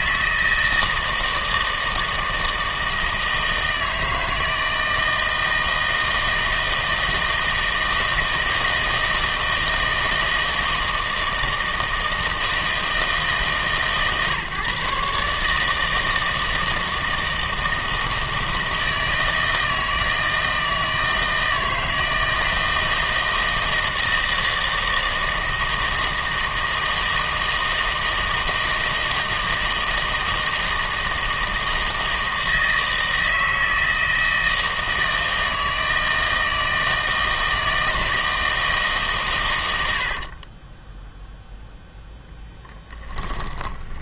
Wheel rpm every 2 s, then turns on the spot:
160, 160, 160, 160, 160, 160, 160, 140, 160, 160, 160, 160, 160, 160, 160, 160, 160, 160, 160, 160, 40, 10.
40-44